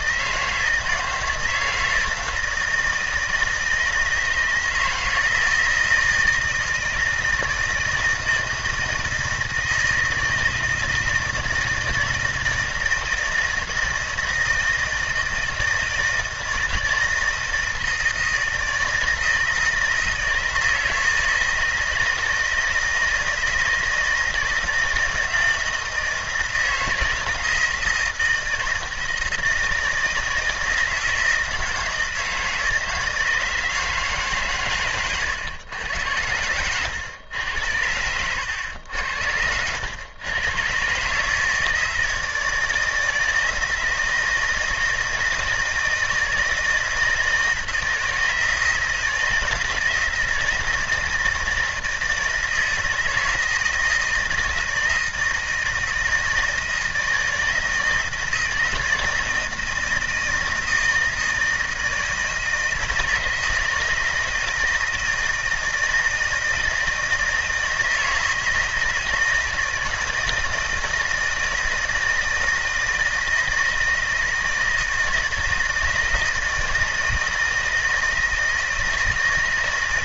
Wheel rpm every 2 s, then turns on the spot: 160, 160, 160, 160, 160, 160, 160, 160, 160, 160, 160, 160, 160, 170, 160, 160, 160, 130, 110, 90, 130, 160, 160, 160, 160, 160, 160, 160, 160, 160, 160, 160, 160, 160, 160, 160, 160, 160, 160, 170.
none